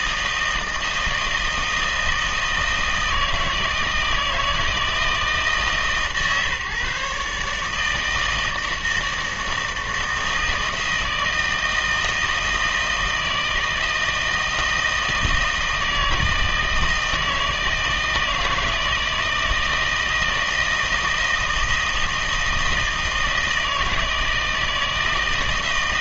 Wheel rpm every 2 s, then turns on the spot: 160, 160, 160, 140, 160, 160, 160, 160, 160, 160, 160, 160, 160.
none